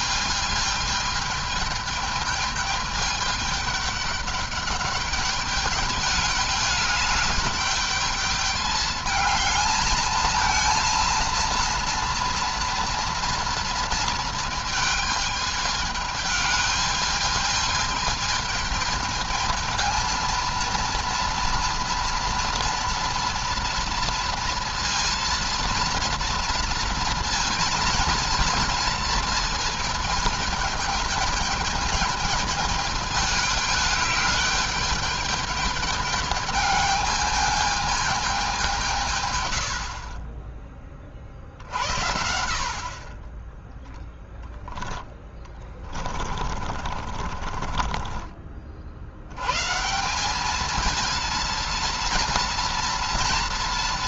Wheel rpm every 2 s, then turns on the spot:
220, 210, 200, 210, 210, 230, 230, 220, 220, 220, 230, 230, 230, 230, 230, 220, 210, 210, 210, 180, 20, 50, 10, 40, 60, 220, 240.
46-48